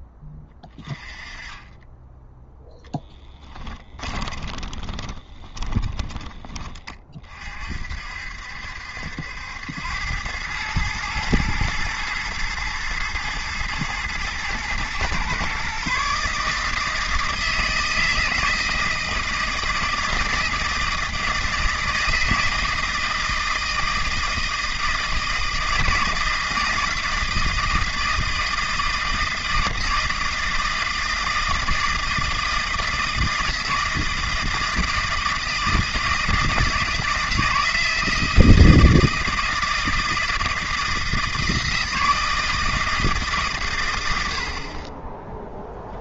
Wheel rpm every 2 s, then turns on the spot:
20, 10, 20, 30, 70, 110, 120, 120, 160, 160, 160, 160, 160, 160, 160, 160, 160, 160, 160, 160, 160, 160, 10.
4-6